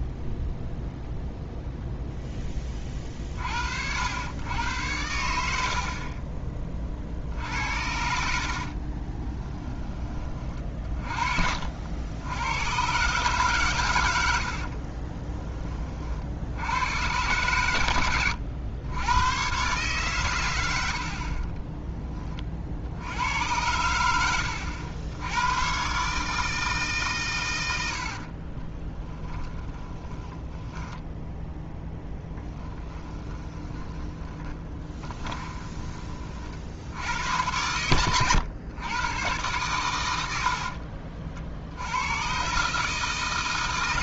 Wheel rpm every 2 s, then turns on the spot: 0, 20, 100, 40, 40, 40, 120, 40, 100, 100, 80, 70, 80, 150, 20, 10, 20, 20, 60, 110, 60, 140.
8-12 14-16 28-36 40-42